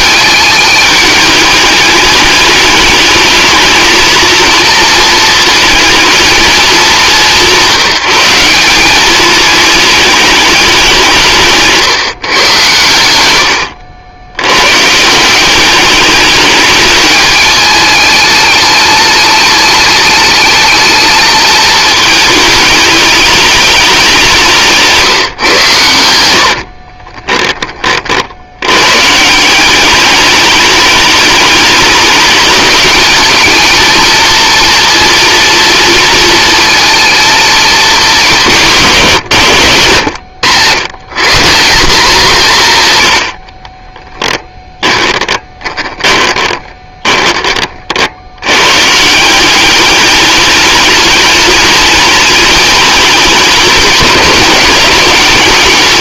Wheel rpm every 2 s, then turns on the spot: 210, 210, 230, 200, 190, 200, 110, 120, 210, 210, 210, 210, 160, 50, 100, 210, 210, 230, 230, 160, 110, 160, 10, 20, 110, 210, 210, 200.
24-28 44-48